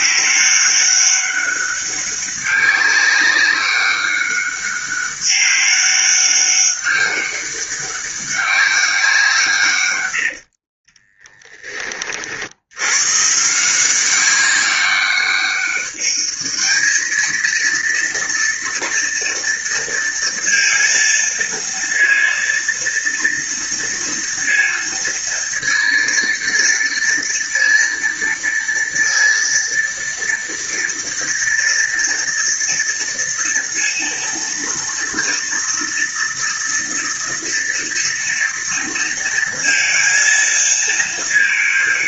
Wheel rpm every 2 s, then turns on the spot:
200, 200, 200, 200, 200, 90, 50, 190, 210, 230, 230, 230, 230, 230, 230, 230, 230, 230, 230, 230, 230.
none